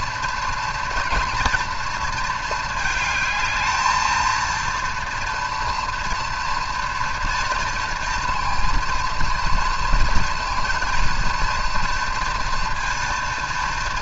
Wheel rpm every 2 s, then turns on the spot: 230, 220, 230, 240, 230, 230, 230.
none